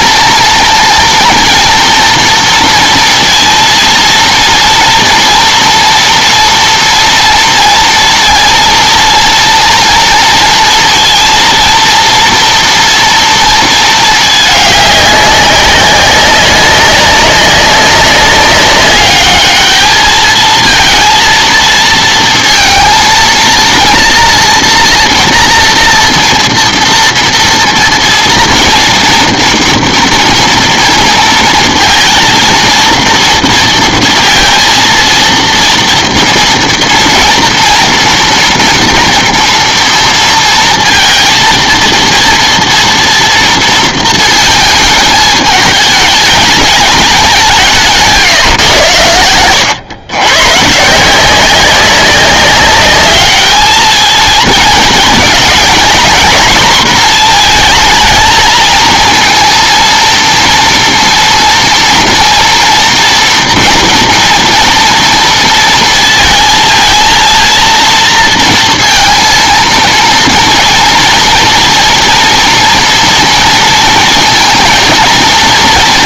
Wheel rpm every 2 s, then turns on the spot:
230, 230, 230, 230, 230, 230, 230, 210, 200, 200, 220, 230, 230, 230, 230, 230, 230, 230, 230, 230, 230, 230, 220, 200, 120, 140, 200, 220, 240, 220, 230, 230, 230, 220, 230, 230, 230, 230.
none